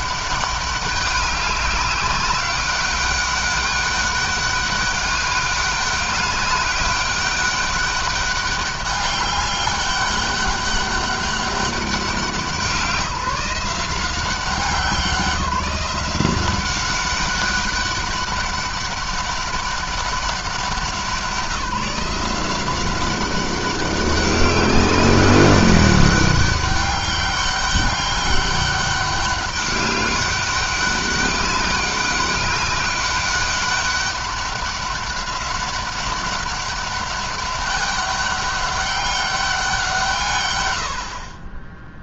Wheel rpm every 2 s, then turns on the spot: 200, 200, 200, 200, 200, 200, 180, 190, 190, 200, 190, 180, 190, 200, 200, 200, 200, 200, 200, 200, 120.
none